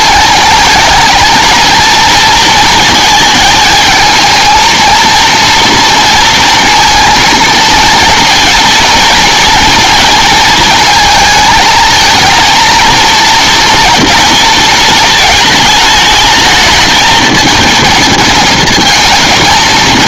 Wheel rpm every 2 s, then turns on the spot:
220, 230, 230, 230, 230, 220, 230, 230, 220, 220.
none